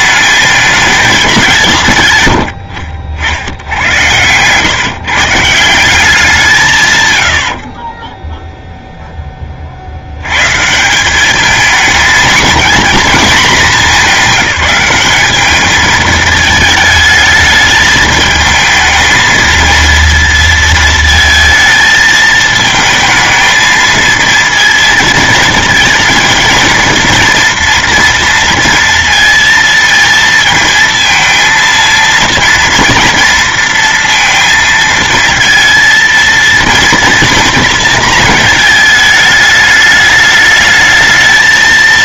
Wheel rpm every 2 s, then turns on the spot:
210, 70, 130, 140, 0, 160, 230, 210, 220, 220, 230, 220, 220, 230, 230, 230, 230, 230, 230, 220, 220.
none